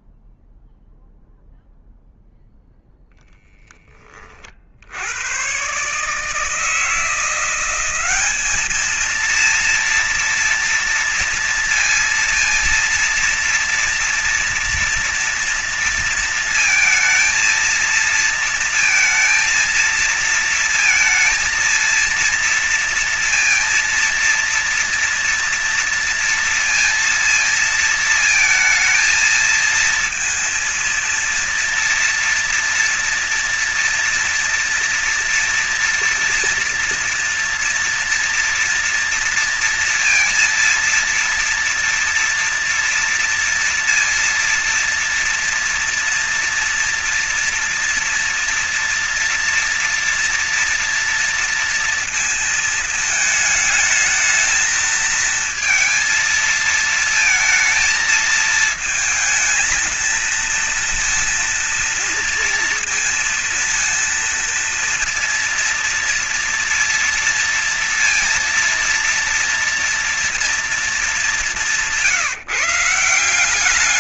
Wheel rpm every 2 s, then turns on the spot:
0, 0, 50, 160, 210, 230, 230, 240, 230, 230, 230, 230, 230, 230, 230, 230, 230, 230, 230, 230, 230, 230, 240, 230, 230, 230, 230, 220, 220, 220, 230, 230, 230, 230, 230, 230, 180.
none